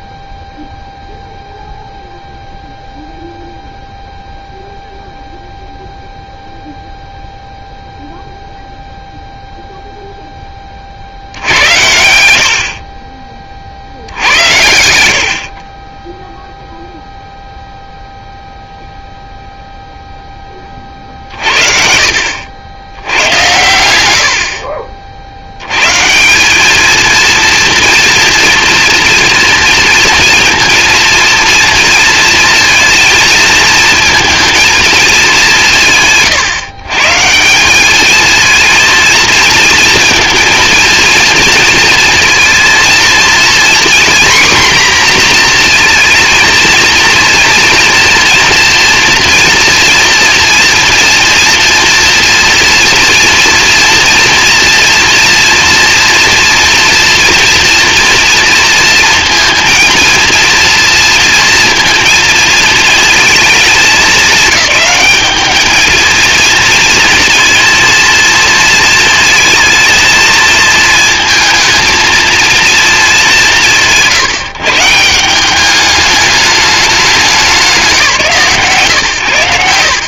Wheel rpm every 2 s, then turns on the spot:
0, 0, 0, 0, 0, 50, 40, 90, 0, 0, 40, 90, 60, 210, 240, 230, 230, 220, 140, 230, 230, 230, 250, 230, 230, 240, 230, 240, 230, 220, 230, 220, 210, 230, 220, 220, 220, 160, 200, 120.
none